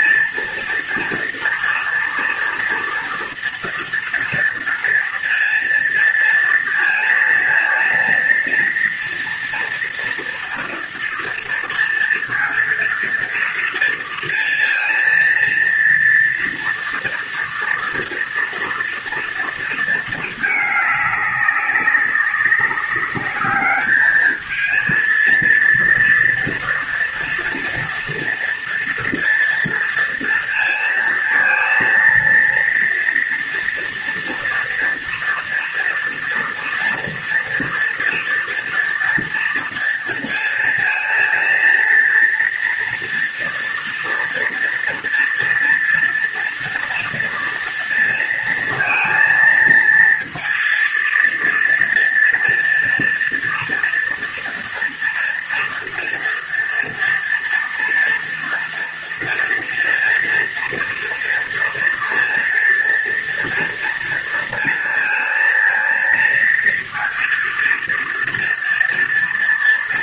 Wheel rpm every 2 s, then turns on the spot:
230, 230, 230, 230, 230, 230, 230, 230, 230, 230, 220, 190, 220, 230, 230, 230, 230, 230, 230, 230, 230, 230, 240, 230, 230, 230, 230, 230, 230, 230, 230, 230, 230, 230, 230.
none